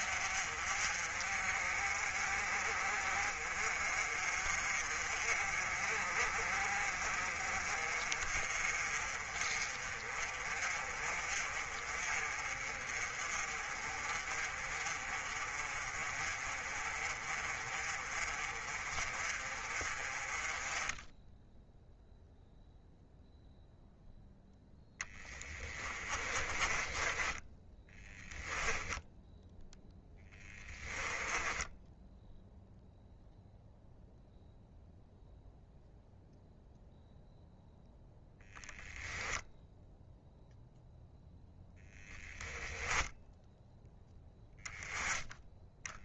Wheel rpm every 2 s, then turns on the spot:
40, 40, 40, 40, 40, 40, 30, 30, 30, 30, 20, 0, 10, 20, 10, 10, 0, 0, 0, 0, 0, 0, 0.
24-32